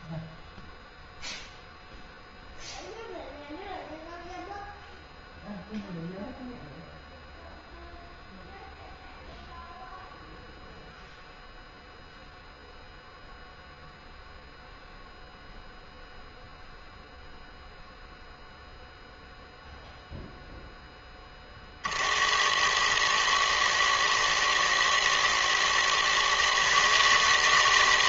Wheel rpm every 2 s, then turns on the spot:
0, 0, 0, 0, 0, 0, 0, 0, 0, 0, 50, 110, 120, 160.
none